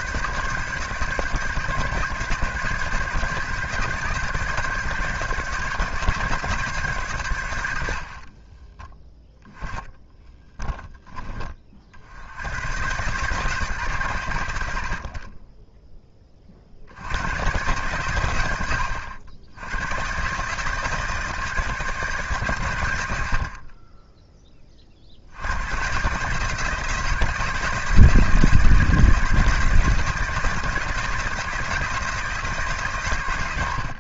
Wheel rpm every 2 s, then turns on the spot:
150, 140, 140, 130, 20, 10, 110, 60, 60, 90, 150, 110, 40, 160, 160, 170, 140.
8-10